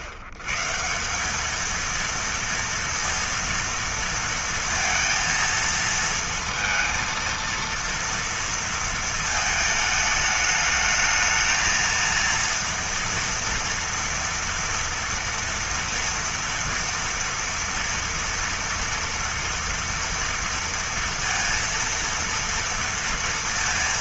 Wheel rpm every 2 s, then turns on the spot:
130, 230, 230, 230, 230, 220, 230, 230, 230, 230, 230, 230.
none